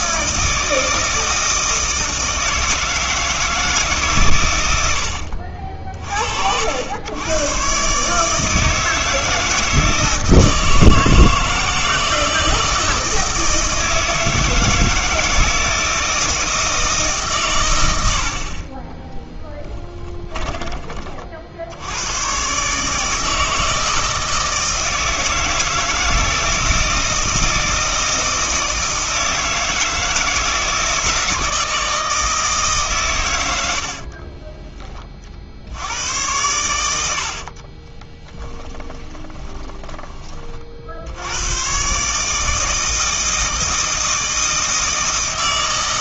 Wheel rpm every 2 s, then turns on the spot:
160, 160, 120, 70, 160, 160, 160, 160, 160, 40, 30, 140, 160, 170, 160, 160, 150, 40, 100, 10, 40, 160, 160.
20-22 34-36 38-40